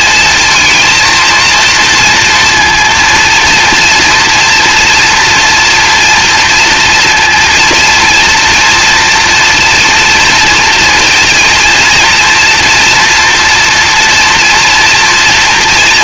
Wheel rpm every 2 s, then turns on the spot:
230, 230, 230, 230, 230, 240, 230, 240.
none